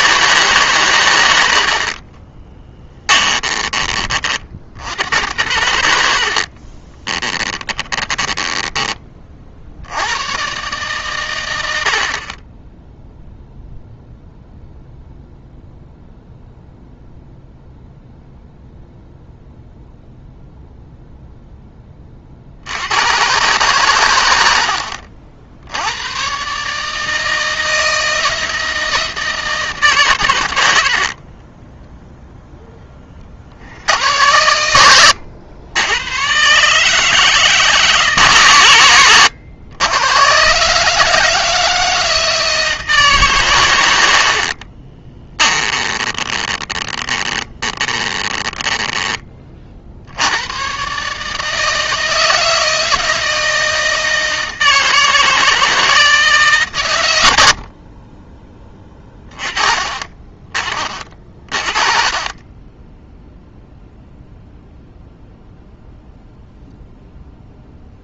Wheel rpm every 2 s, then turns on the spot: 140, 20, 60, 40, 10, 140, 20, 0, 0, 0, 0, 70, 70, 140, 160, 80, 10, 100, 140, 120, 130, 160, 40, 30, 20, 110, 160, 160, 150, 20, 30, 20, 0, 0.
2-4 6-8 30-32 44-50